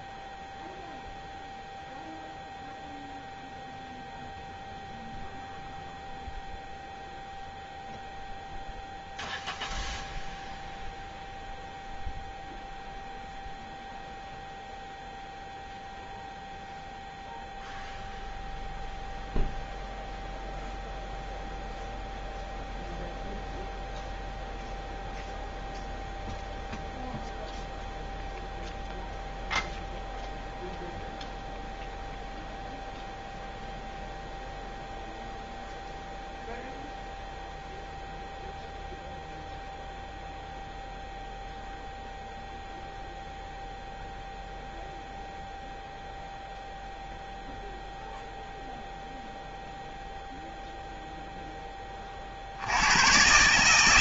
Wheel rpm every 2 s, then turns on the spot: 0, 0, 0, 0, 0, 0, 0, 0, 0, 0, 0, 0, 0, 0, 0, 0, 0, 0, 0, 0, 0, 0, 0, 0, 0, 0, 90.
none